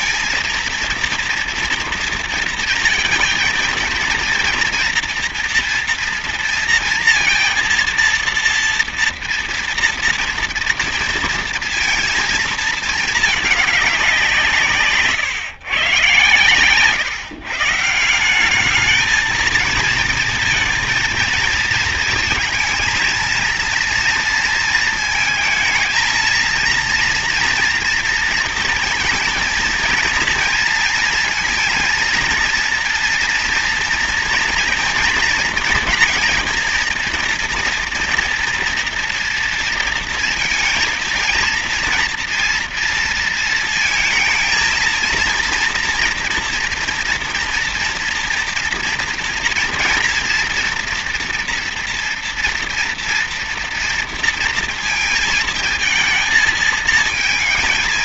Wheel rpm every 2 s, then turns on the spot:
230, 230, 240, 230, 230, 230, 220, 170, 120, 180, 230, 220, 230, 230, 230, 230, 230, 230, 230, 240, 230, 230, 220, 230, 230, 230, 230, 230, 220.
none